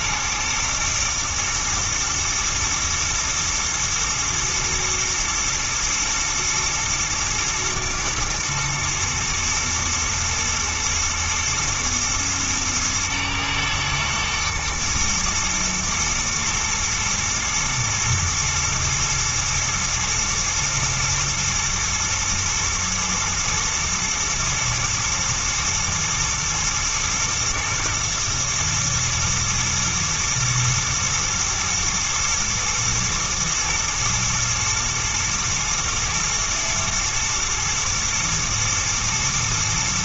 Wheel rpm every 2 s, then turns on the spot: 120, 120, 110, 110, 110, 110, 110, 110, 110, 110, 120, 110, 110, 110, 110, 120, 110, 110, 120, 120.
none